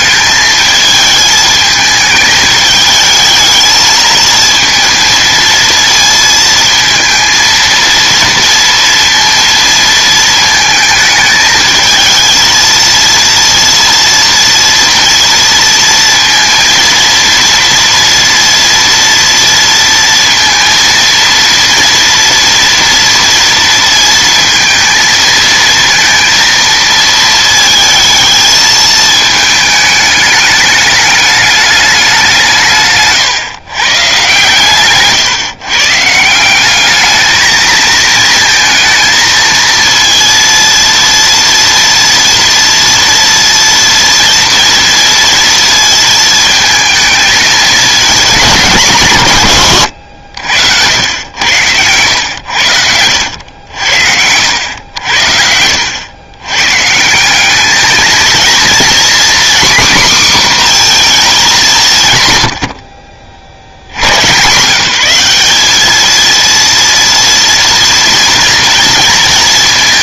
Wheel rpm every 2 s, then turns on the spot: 220, 210, 220, 230, 230, 220, 230, 230, 230, 230, 230, 230, 230, 230, 220, 210, 140, 130, 200, 230, 230, 230, 230, 220, 180, 80, 90, 90, 130, 240, 250, 80, 150, 230, 230.
32-34 52-54